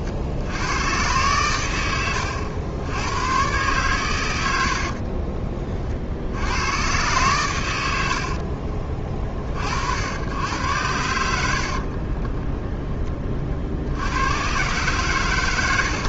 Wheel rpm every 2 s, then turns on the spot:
110, 100, 50, 110, 40, 90, 20, 130.
4-6